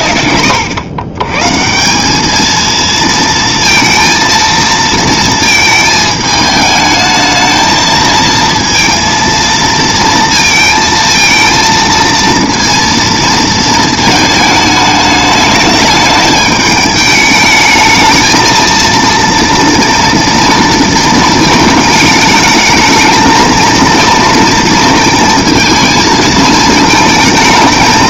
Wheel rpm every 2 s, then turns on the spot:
110, 220, 230, 220, 230, 230, 230, 220, 210, 230, 230, 220, 230, 220.
none